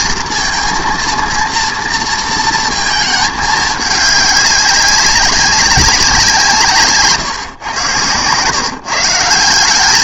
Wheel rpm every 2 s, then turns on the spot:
230, 230, 200, 150, 140.
none